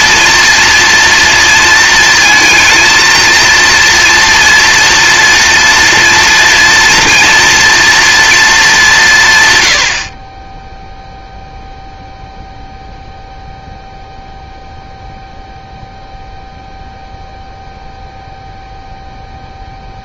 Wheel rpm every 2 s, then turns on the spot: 230, 230, 230, 230, 180, 0, 0, 0, 0, 0.
none